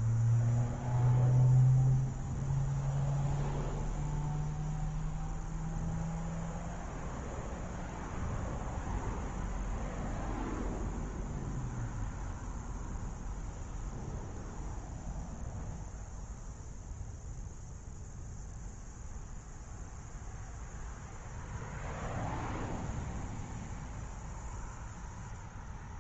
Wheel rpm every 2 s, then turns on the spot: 0, 0, 0, 0, 0, 0, 0, 0, 0, 0, 0, 0, 0.
none